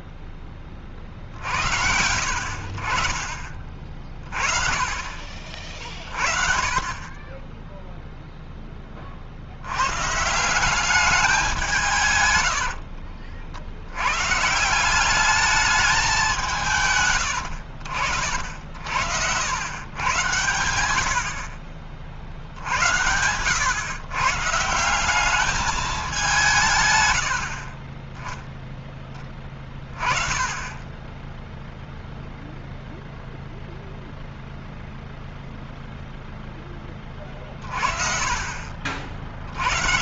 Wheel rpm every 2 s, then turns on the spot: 30, 60, 30, 40, 10, 170, 100, 150, 170, 80, 100, 70, 140, 160, 10, 20, 0, 0, 10, 50.
12-14 18-20